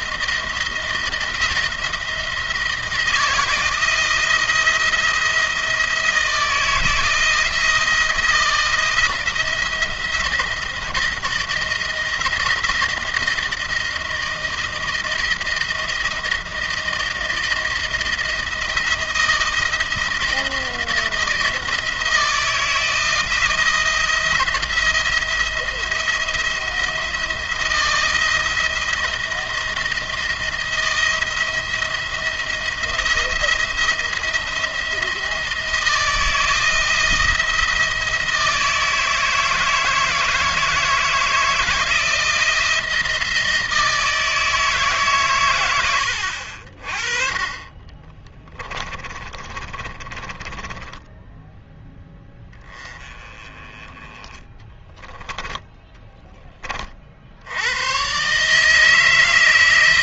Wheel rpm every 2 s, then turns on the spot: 170, 160, 170, 170, 160, 170, 170, 170, 160, 160, 170, 160, 170, 170, 170, 170, 170, 170, 170, 160, 160, 160, 150, 50, 20, 10, 20, 10, 40, 160.
48-52 54-56